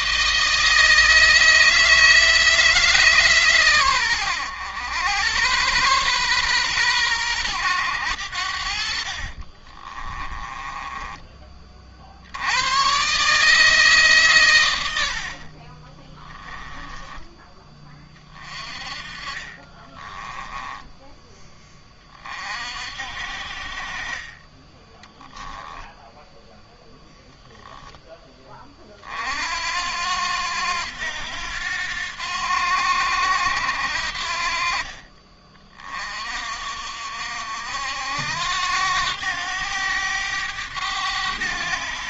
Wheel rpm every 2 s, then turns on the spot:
160, 150, 100, 110, 60, 20, 120, 80, 10, 30, 10, 50, 10, 0, 40, 90, 80, 40, 60, 90, 100.
8-12 14-16 18-20 24-26